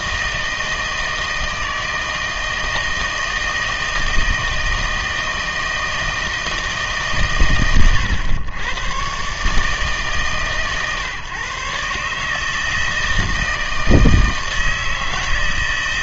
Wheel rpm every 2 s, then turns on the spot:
160, 160, 160, 150, 120, 130, 160, 160.
none